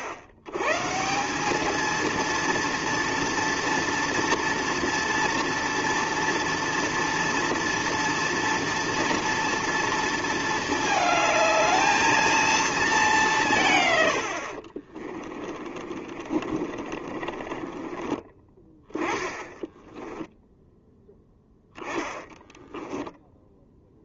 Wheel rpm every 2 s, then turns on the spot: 80, 230, 230, 230, 230, 220, 220, 40, 30, 20, 0, 10.
14-18